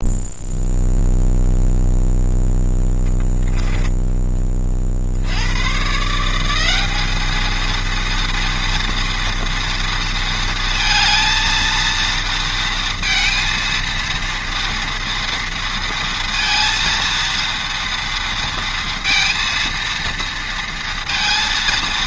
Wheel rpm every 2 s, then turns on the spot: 0, 0, 40, 200, 230, 220, 230, 230, 230, 230, 230.
none